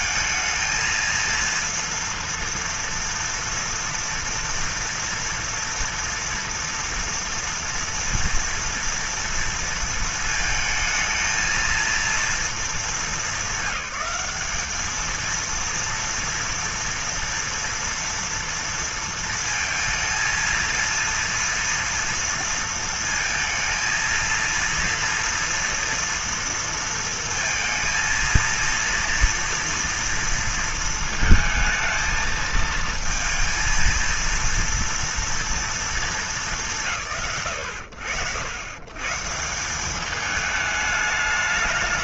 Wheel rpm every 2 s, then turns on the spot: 220, 230, 230, 230, 230, 230, 230, 200, 230, 240, 220, 230, 230, 230, 230, 230, 220, 230, 220, 90, 210.
none